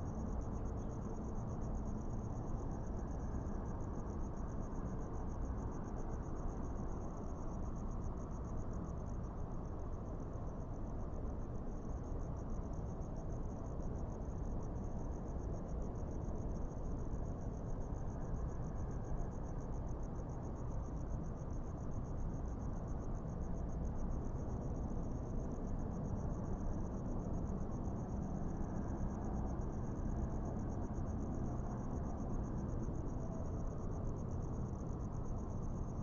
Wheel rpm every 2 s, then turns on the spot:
0, 0, 0, 0, 0, 0, 0, 0, 0, 0, 0, 0, 0, 0, 0, 0, 0, 0.
none